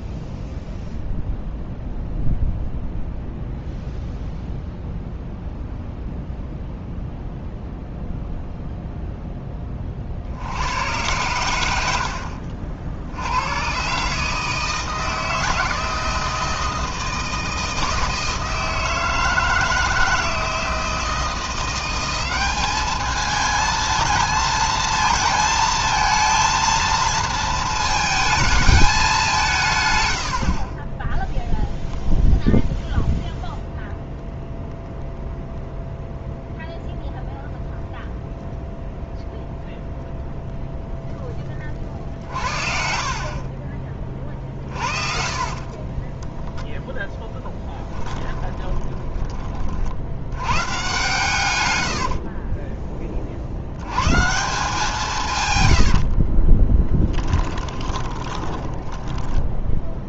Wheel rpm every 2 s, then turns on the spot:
0, 0, 0, 0, 0, 100, 60, 160, 160, 160, 160, 210, 230, 230, 210, 20, 0, 0, 0, 0, 0, 50, 40, 0, 30, 130, 20, 170, 10, 20.
30-32 44-46 48-50 56-60